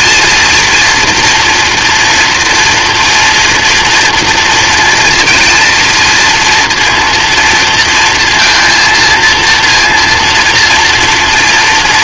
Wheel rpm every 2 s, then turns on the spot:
230, 240, 230, 230, 220, 230.
none